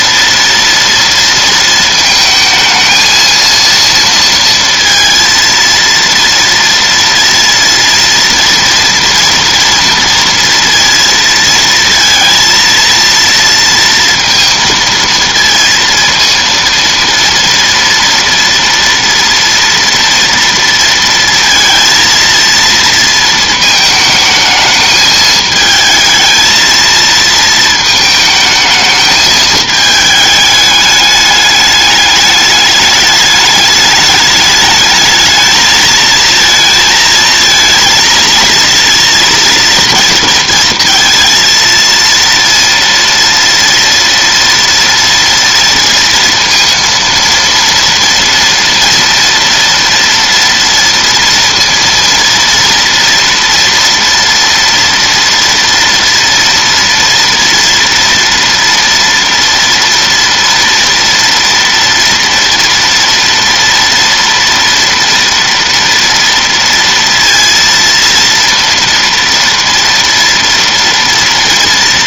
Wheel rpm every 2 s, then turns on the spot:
230, 220, 230, 230, 230, 230, 230, 230, 230, 230, 230, 230, 220, 230, 220, 210, 210, 210, 230, 230, 230, 230, 230, 230, 230, 230, 230, 230, 230, 230, 230, 230, 230, 230, 230, 230.
none